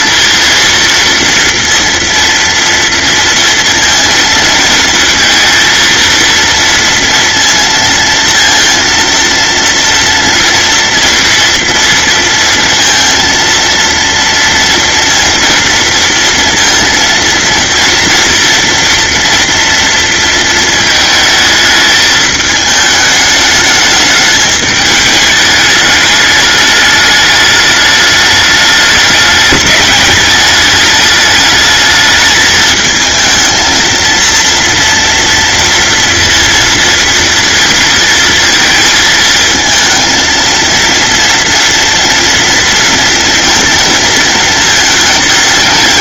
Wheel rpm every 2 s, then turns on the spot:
230, 230, 230, 230, 230, 230, 230, 230, 230, 240, 220, 220, 210, 210, 210, 210, 220, 230, 230, 220, 230, 230, 210.
none